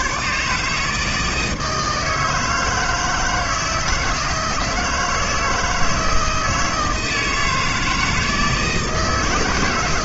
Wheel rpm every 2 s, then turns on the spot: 150, 160, 160, 160, 160.
none